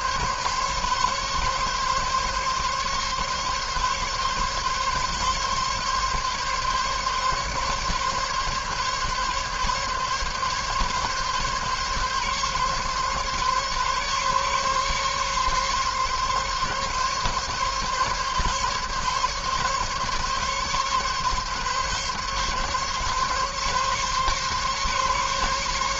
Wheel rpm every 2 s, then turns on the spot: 140, 140, 140, 140, 140, 140, 140, 140, 140, 140, 140, 140, 140.
none